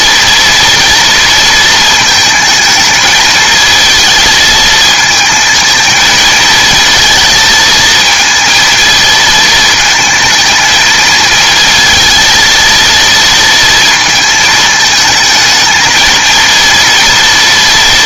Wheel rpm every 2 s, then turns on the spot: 230, 220, 220, 220, 230, 220, 230, 220, 230.
none